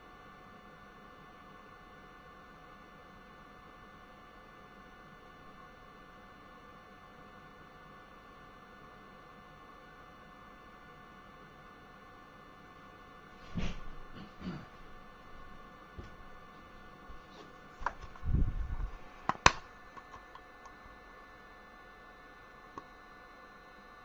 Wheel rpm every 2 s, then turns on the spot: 0, 0, 0, 0, 0, 0, 0, 0, 0, 0, 0, 0.
none